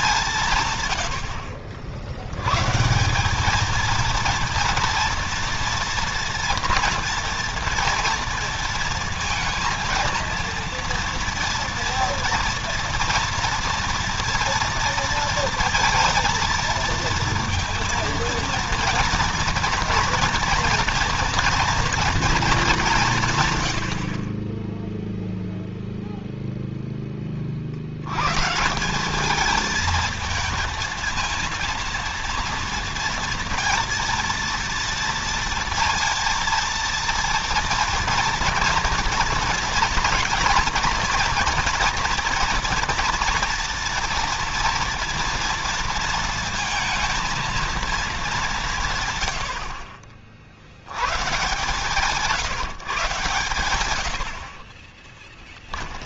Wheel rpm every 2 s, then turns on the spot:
140, 140, 230, 240, 230, 230, 230, 230, 230, 230, 230, 210, 20, 0, 160, 220, 230, 230, 230, 230, 230, 230, 230, 230, 180, 70, 160, 50.
54-56